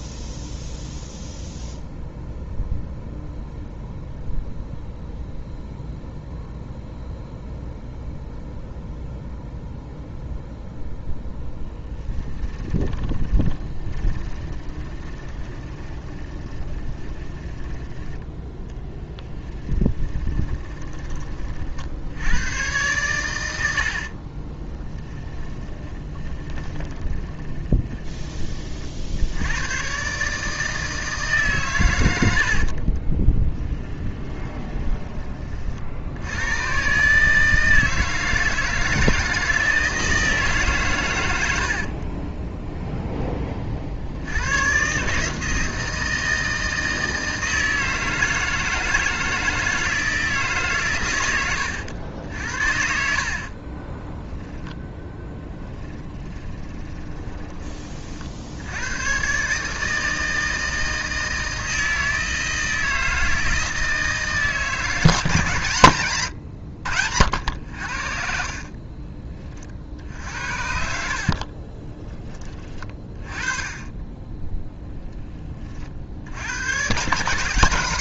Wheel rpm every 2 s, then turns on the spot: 0, 0, 0, 0, 0, 0, 30, 20, 20, 10, 20, 110, 40, 20, 40, 160, 60, 20, 120, 160, 160, 20, 100, 160, 160, 140, 70, 10, 20, 70, 160, 160, 160, 100, 40, 60, 20, 10, 100.
12-18 20-22 24-28 32-36 42-44 52-54 56-58 68-72